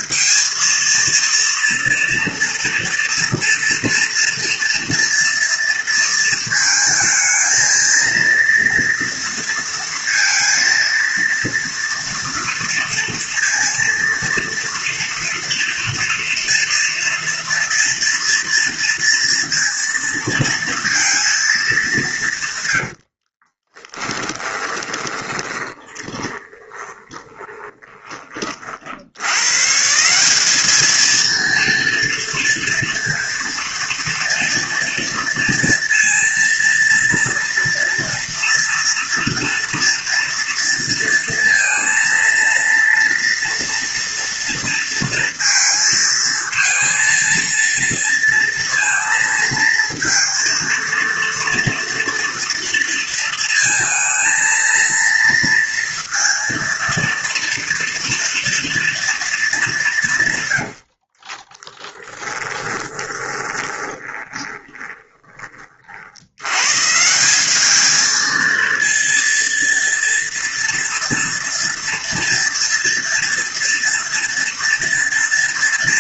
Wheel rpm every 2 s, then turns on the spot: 230, 230, 230, 220, 230, 230, 230, 230, 230, 230, 230, 110, 30, 20, 50, 210, 230, 230, 230, 230, 230, 240, 230, 230, 230, 230, 230, 230, 230, 230, 90, 20, 20, 130, 230, 230, 230, 240.
22-28 60-66